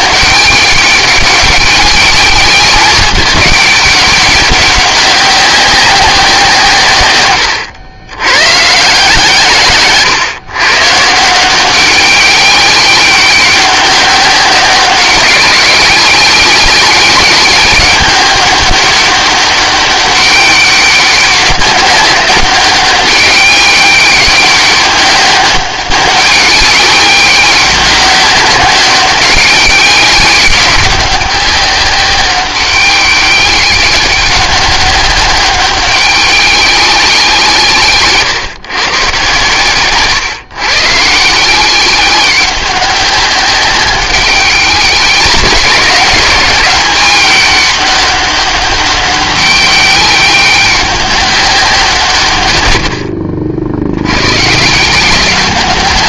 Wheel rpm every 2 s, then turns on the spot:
200, 200, 190, 130, 140, 140, 200, 190, 200, 200, 200, 200, 200, 190, 190, 190, 190, 200, 190, 120, 140, 190, 180, 190, 200, 190, 90, 160.
none